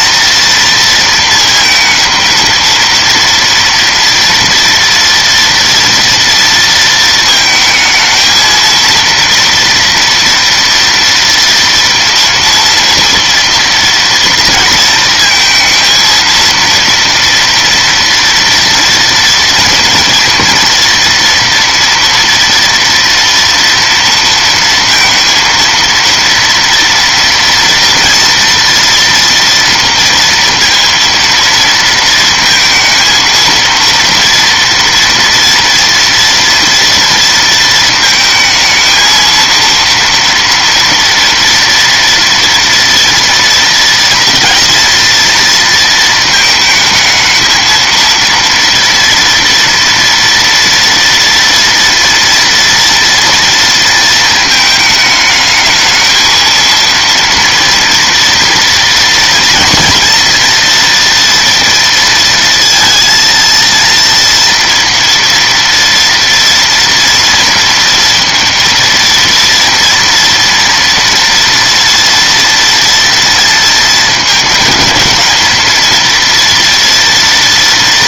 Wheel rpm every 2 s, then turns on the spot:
230, 230, 230, 230, 220, 230, 230, 230, 230, 230, 230, 230, 230, 230, 230, 230, 230, 230, 230, 220, 230, 230, 230, 220, 230, 230, 230, 220, 220, 230, 230, 230, 230, 240, 230, 230, 230, 220, 230.
none